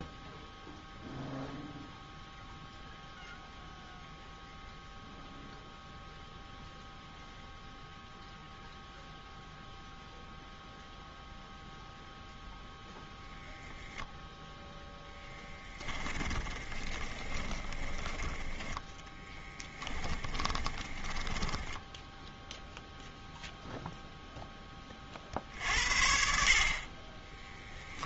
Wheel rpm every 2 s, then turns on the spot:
0, 0, 0, 0, 0, 0, 0, 0, 20, 10, 10, 0, 30, 50.
16-18 20-22